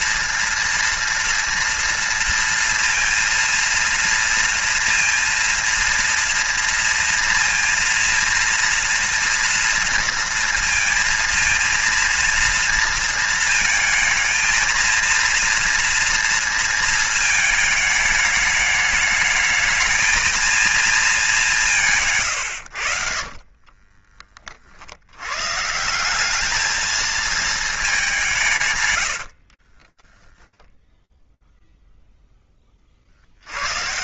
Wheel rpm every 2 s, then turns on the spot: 230, 230, 230, 230, 230, 230, 230, 230, 230, 210, 220, 90, 50, 220, 130, 10, 40.
22-24